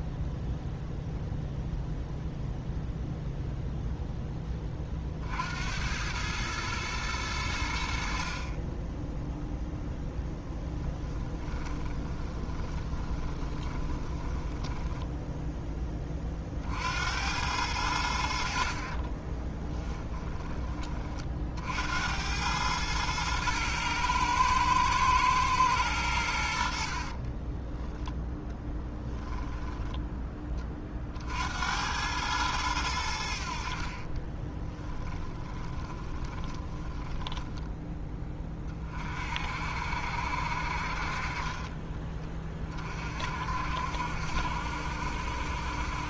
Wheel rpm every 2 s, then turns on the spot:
0, 0, 30, 110, 20, 20, 20, 10, 60, 40, 20, 110, 110, 70, 10, 30, 90, 20, 10, 30, 50, 40, 70.
10-16 18-20 28-30 34-38